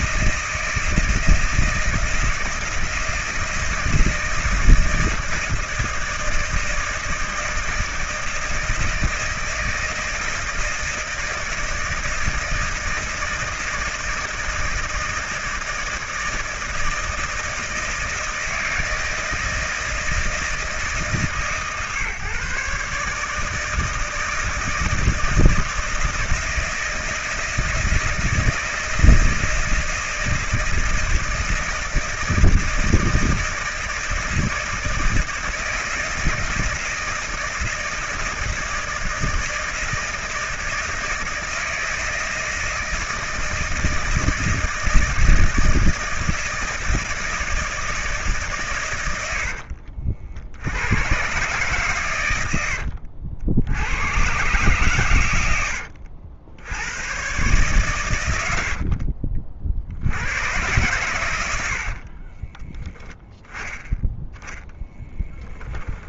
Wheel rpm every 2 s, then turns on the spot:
160, 160, 160, 160, 160, 160, 160, 160, 160, 160, 160, 140, 160, 160, 160, 160, 160, 160, 160, 160, 160, 160, 160, 160, 140, 80, 100, 120, 80, 90, 110, 20, 0.
58-60 62-64